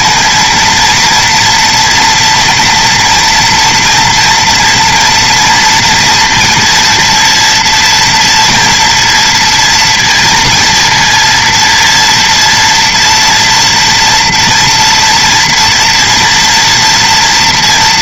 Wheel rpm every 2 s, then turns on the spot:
230, 240, 230, 230, 230, 230, 230, 240, 240.
none